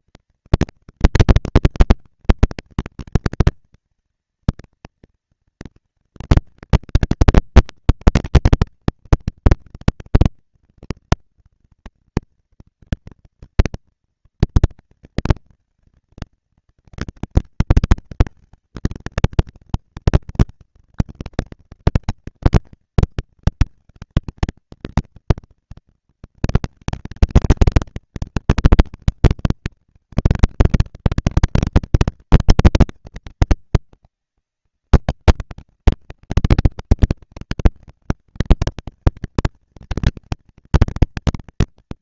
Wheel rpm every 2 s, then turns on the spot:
220, 230, 230, 230, 240, 240, 230, 230, 230, 230, 230, 230, 230, 230, 230, 230, 230, 200, 190, 210, 230.
none